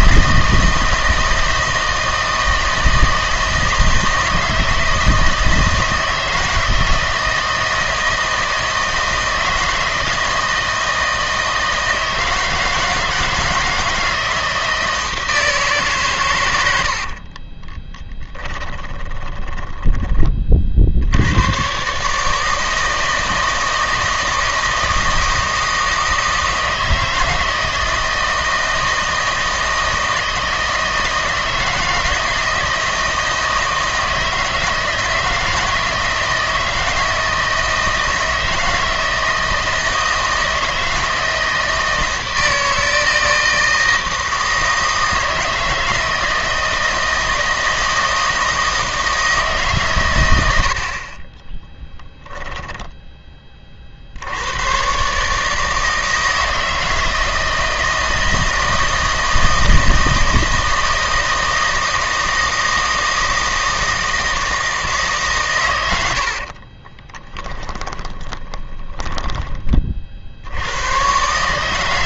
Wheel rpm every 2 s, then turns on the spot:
160, 160, 160, 160, 160, 160, 160, 160, 100, 30, 40, 160, 160, 160, 160, 160, 160, 160, 160, 160, 160, 160, 160, 160, 160, 80, 0, 110, 160, 160, 160, 160, 160, 40, 30, 90.
18-20 66-70